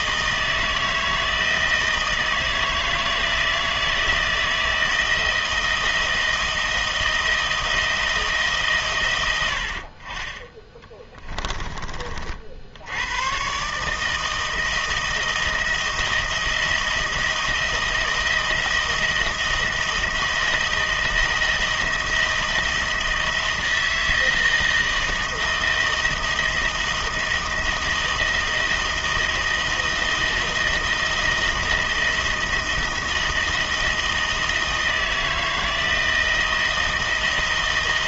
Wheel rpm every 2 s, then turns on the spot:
160, 160, 160, 160, 150, 20, 70, 160, 160, 160, 160, 160, 160, 160, 160, 170, 170, 160, 170.
none